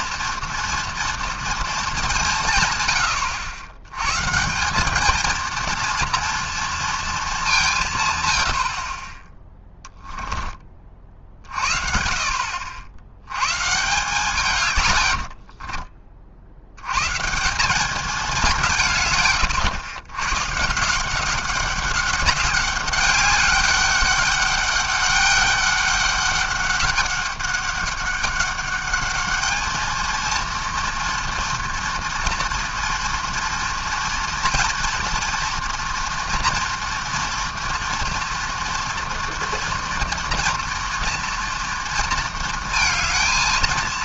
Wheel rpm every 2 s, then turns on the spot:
230, 140, 180, 230, 80, 20, 70, 140, 80, 170, 140, 190, 200, 200, 200, 230, 230, 240, 230, 240, 230, 230.
14-16